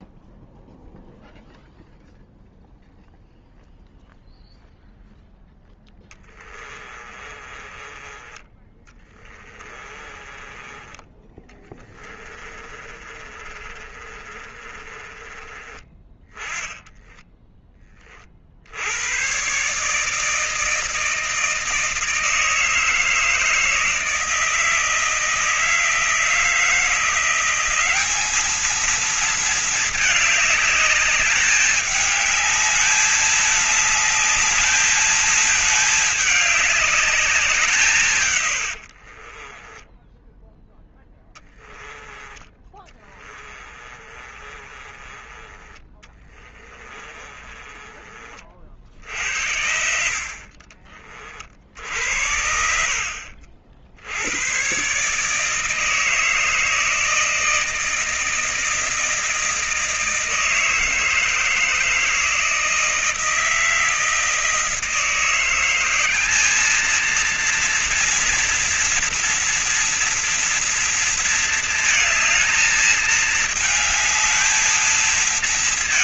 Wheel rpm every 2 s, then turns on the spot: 0, 0, 0, 20, 20, 30, 20, 30, 20, 50, 160, 160, 160, 170, 210, 210, 210, 210, 210, 120, 10, 20, 30, 20, 40, 60, 60, 100, 160, 160, 160, 160, 160, 200, 230, 230, 220, 220.
6-18 38-48 50-54